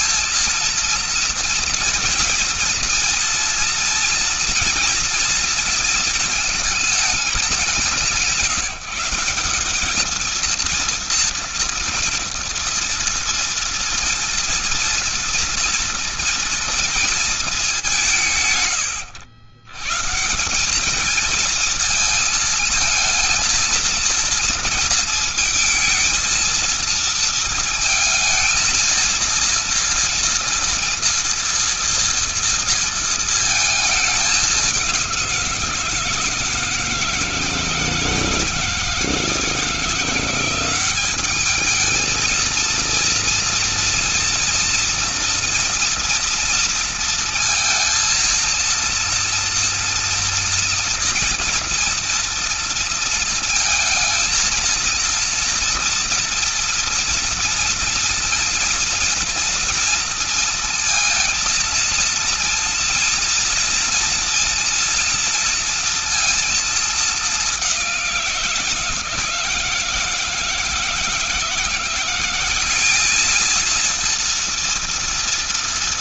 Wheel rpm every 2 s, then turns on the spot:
230, 230, 230, 230, 180, 220, 230, 230, 230, 140, 160, 220, 230, 230, 220, 240, 240, 210, 160, 160, 170, 220, 230, 230, 230, 230, 230, 220, 230, 230, 230, 230, 240, 230, 180, 160, 180, 230.
none